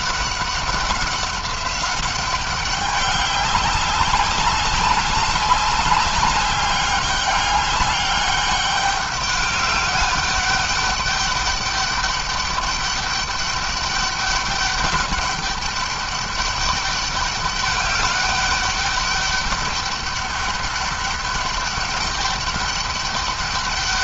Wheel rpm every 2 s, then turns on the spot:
190, 200, 200, 200, 200, 200, 200, 210, 200, 200, 200, 200.
none